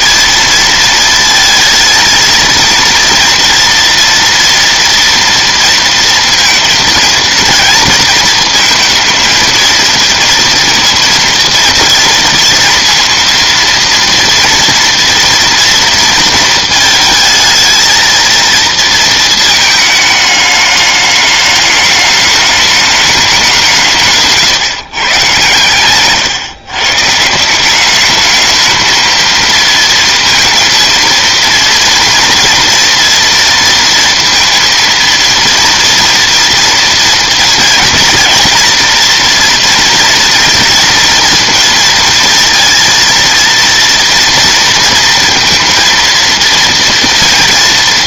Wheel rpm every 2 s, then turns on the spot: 230, 230, 230, 230, 220, 230, 230, 240, 230, 230, 210, 210, 140, 140, 220, 230, 230, 230, 230, 230, 230, 230, 230, 230.
none